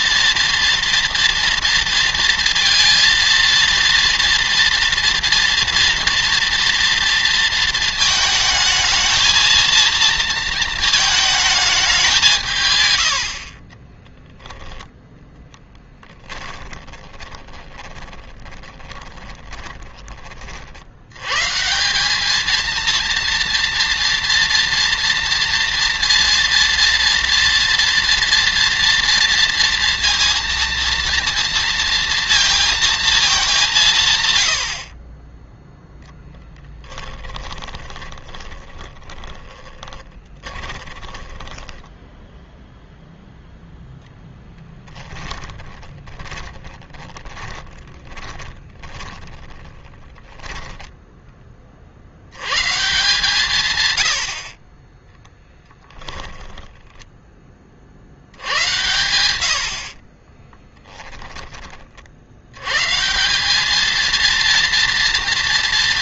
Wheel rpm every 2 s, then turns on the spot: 230, 230, 230, 230, 220, 220, 130, 10, 10, 20, 70, 230, 230, 230, 230, 230, 230, 70, 10, 20, 20, 0, 10, 10, 30, 10, 140, 40, 10, 90, 10, 120, 230.
12-14 16-20 36-42 44-52 56-58 60-62